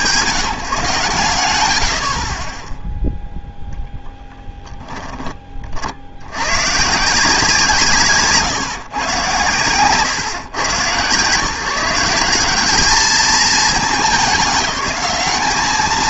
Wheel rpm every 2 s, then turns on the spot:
170, 10, 10, 130, 150, 130, 180, 200.
none